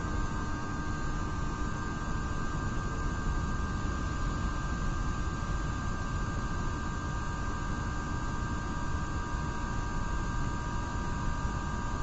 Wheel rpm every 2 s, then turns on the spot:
0, 0, 0, 0, 0, 0.
none